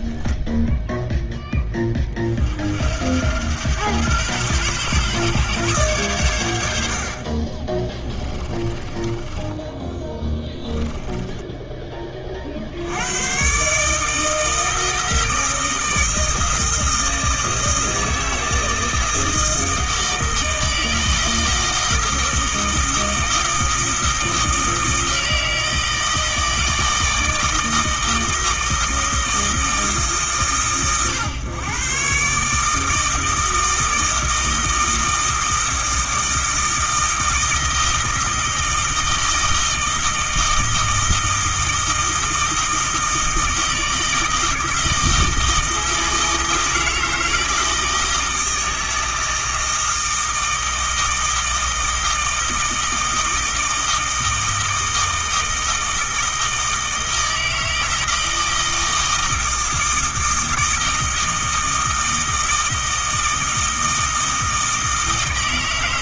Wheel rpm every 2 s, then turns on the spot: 0, 70, 130, 80, 20, 20, 70, 160, 160, 160, 160, 160, 160, 160, 160, 130, 150, 160, 160, 160, 160, 160, 160, 160, 160, 160, 160, 160, 160, 160, 160, 160, 160.
8-12